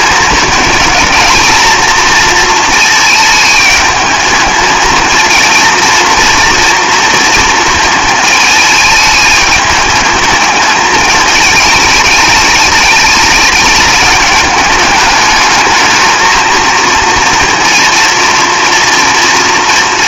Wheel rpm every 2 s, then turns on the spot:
220, 220, 220, 230, 220, 210, 210, 210, 230, 230.
none